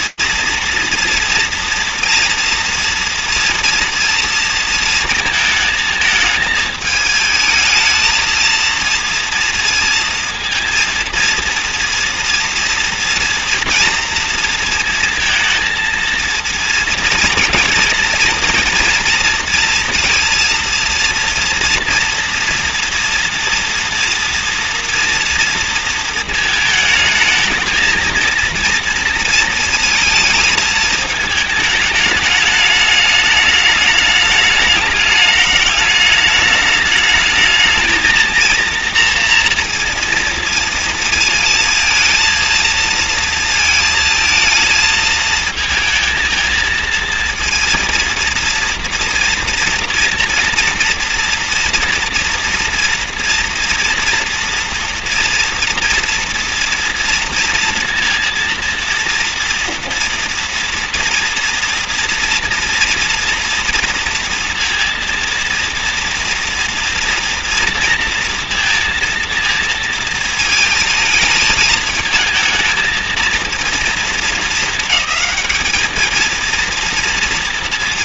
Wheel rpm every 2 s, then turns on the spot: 230, 230, 220, 220, 230, 230, 230, 230, 230, 230, 230, 230, 240, 220, 230, 220, 210, 210, 210, 230, 220, 230, 220, 220, 230, 230, 230, 230, 230, 230, 230, 240, 230, 230, 230, 230, 220, 220, 230.
none